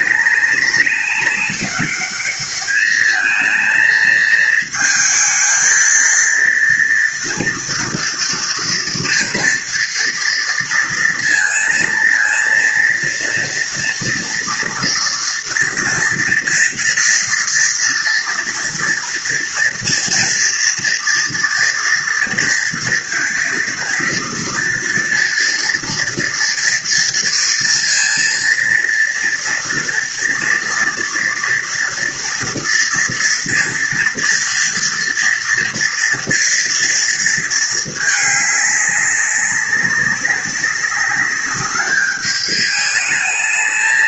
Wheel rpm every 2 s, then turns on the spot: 200, 220, 220, 230, 230, 230, 230, 230, 230, 240, 230, 230, 230, 230, 230, 230, 230, 230, 230, 200, 200, 210.
none